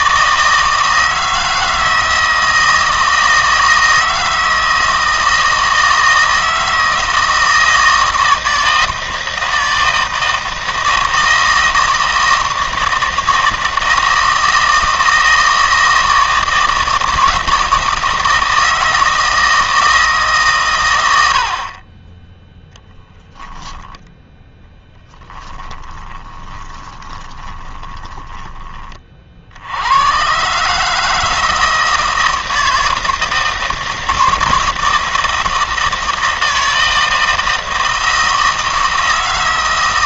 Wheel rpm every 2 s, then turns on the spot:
160, 160, 160, 160, 160, 160, 160, 160, 160, 160, 120, 0, 10, 20, 30, 150, 160, 160, 160, 160.
24-28